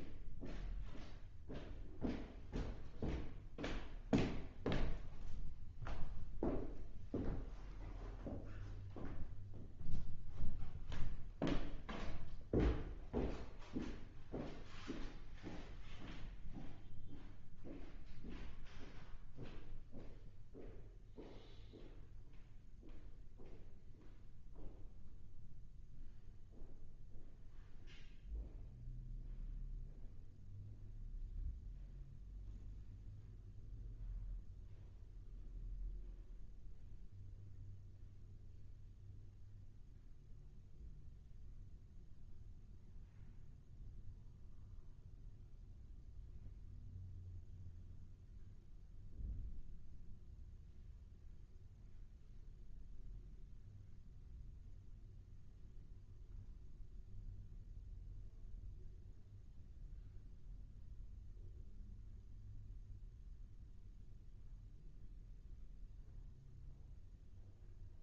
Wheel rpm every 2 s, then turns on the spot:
0, 0, 0, 0, 0, 0, 0, 0, 0, 0, 0, 0, 0, 0, 0, 0, 0, 0, 0, 0, 0, 0, 0, 0, 0, 0, 0, 0, 0, 0, 0, 0, 0, 0.
none